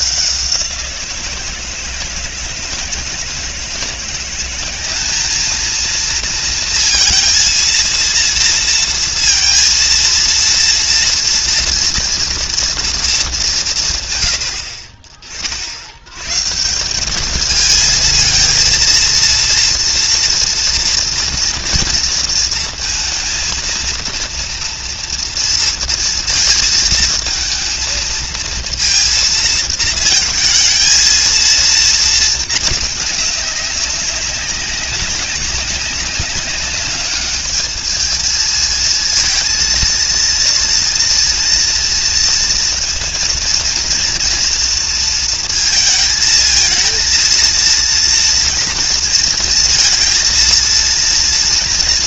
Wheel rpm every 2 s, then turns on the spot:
170, 160, 200, 230, 230, 230, 220, 40, 190, 230, 240, 230, 230, 230, 230, 230, 210, 200, 210, 230, 230, 230, 230, 230, 230, 220.
none